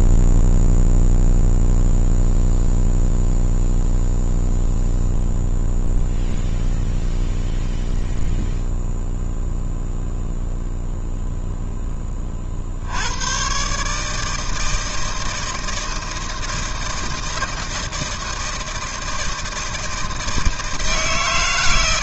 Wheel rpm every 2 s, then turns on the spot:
0, 0, 0, 0, 0, 0, 50, 160, 160, 160, 160.
none